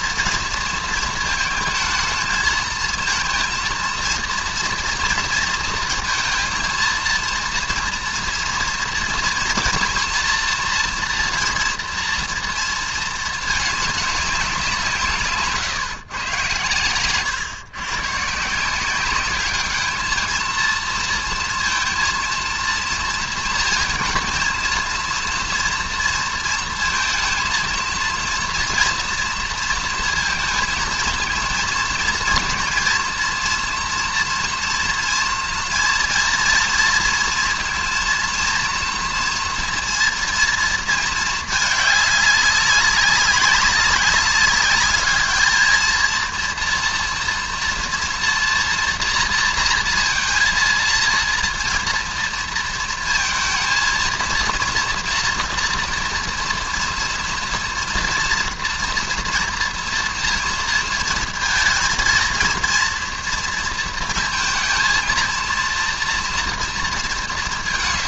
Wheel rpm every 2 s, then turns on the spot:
230, 230, 230, 230, 230, 240, 230, 180, 120, 170, 230, 230, 230, 230, 240, 220, 230, 230, 230, 230, 230, 200, 200, 230, 230, 230, 230, 230, 230, 230, 230, 230, 230, 230.
none